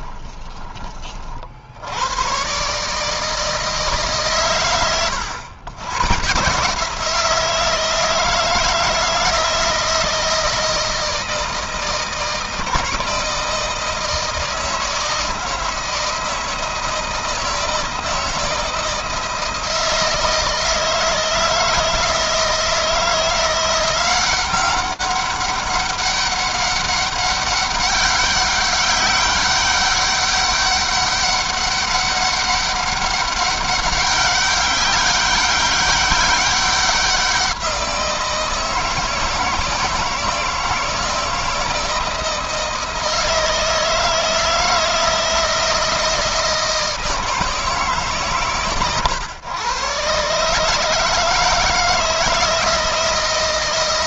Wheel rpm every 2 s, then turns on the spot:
30, 140, 120, 160, 160, 160, 160, 160, 160, 160, 160, 160, 190, 200, 200, 200, 200, 200, 190, 160, 160, 160, 160, 160, 120, 150, 160.
none